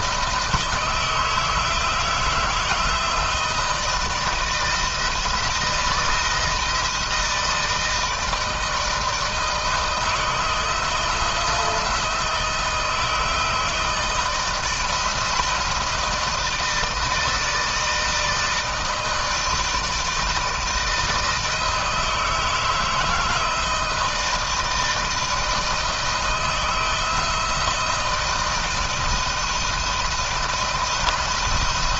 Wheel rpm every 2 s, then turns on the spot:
160, 160, 160, 170, 160, 160, 160, 160, 160, 160, 160, 160, 160, 160, 170, 170.
none